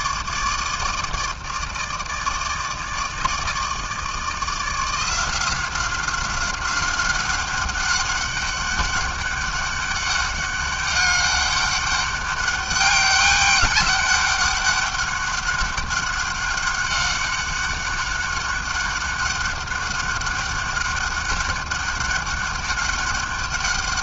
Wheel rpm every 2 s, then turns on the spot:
160, 160, 160, 190, 200, 200, 200, 200, 190, 190, 200, 200.
none